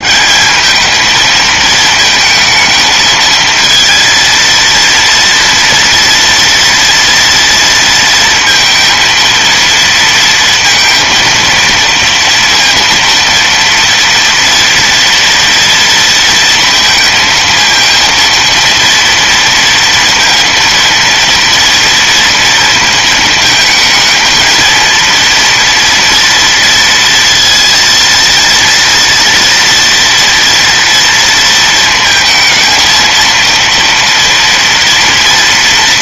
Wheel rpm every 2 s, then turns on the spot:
220, 220, 230, 230, 230, 230, 230, 230, 230, 230, 230, 220, 230, 230, 230, 230, 230, 230.
none